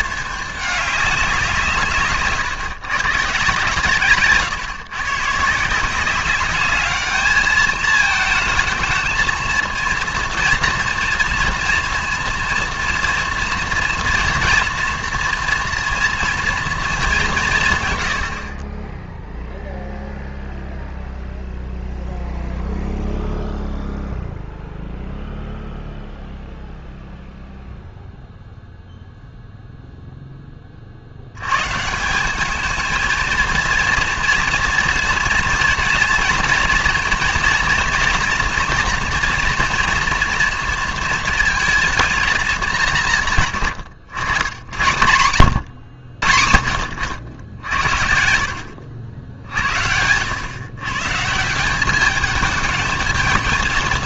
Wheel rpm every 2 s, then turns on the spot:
210, 140, 130, 200, 220, 230, 230, 230, 230, 30, 0, 0, 0, 0, 0, 30, 220, 230, 230, 230, 230, 200, 80, 70, 80, 120, 220.
none